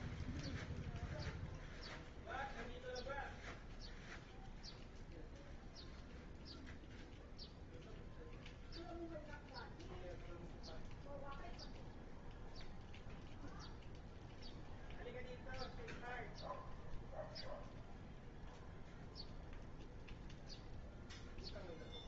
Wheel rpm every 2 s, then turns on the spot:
0, 0, 0, 0, 0, 0, 0, 0, 0, 0, 0.
none